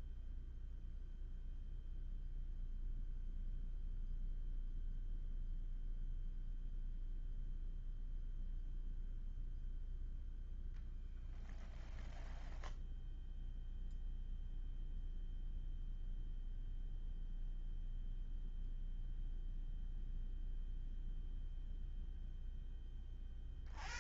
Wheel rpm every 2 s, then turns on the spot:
0, 0, 0, 0, 0, 0, 0, 0, 0, 0, 0, 0.
none